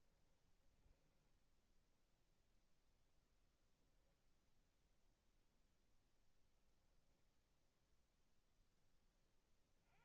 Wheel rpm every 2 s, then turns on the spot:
10, 0, 0, 0, 10.
0-2